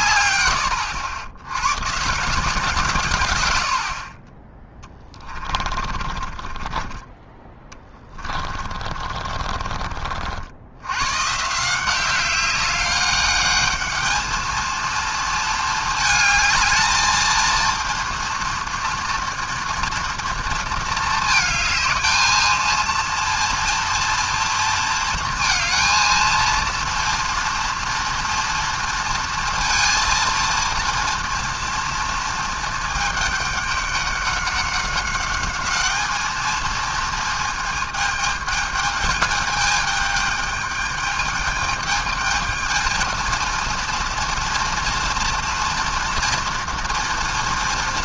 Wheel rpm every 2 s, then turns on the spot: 110, 160, 10, 20, 30, 80, 190, 220, 220, 230, 230, 220, 230, 230, 230, 230, 220, 200, 220, 210, 210, 220, 230, 230.
6-10